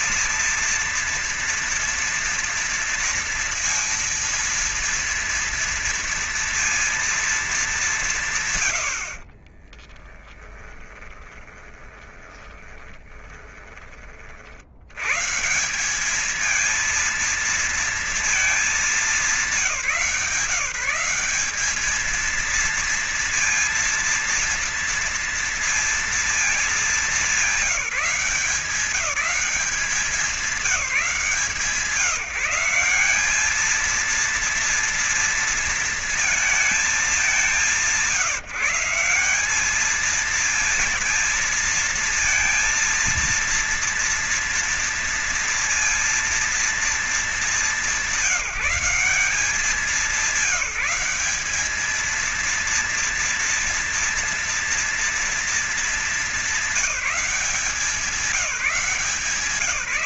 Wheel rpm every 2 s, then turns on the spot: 230, 230, 230, 230, 150, 20, 20, 70, 220, 230, 180, 230, 230, 210, 170, 180, 180, 230, 220, 170, 230, 230, 230, 230, 190, 200, 230, 240, 190, 160.
10-14